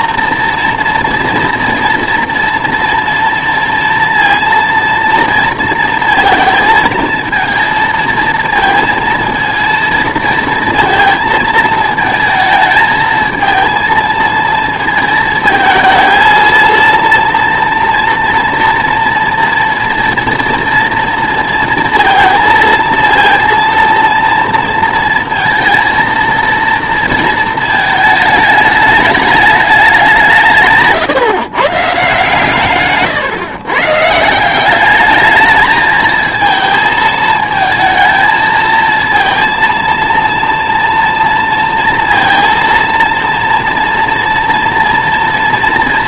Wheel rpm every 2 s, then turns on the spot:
230, 240, 230, 230, 220, 230, 220, 220, 230, 230, 230, 230, 230, 230, 210, 150, 130, 200, 220, 220, 230, 230, 240.
none